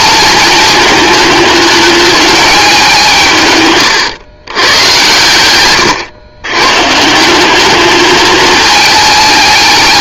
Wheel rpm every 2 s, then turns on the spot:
220, 200, 110, 130, 220.
none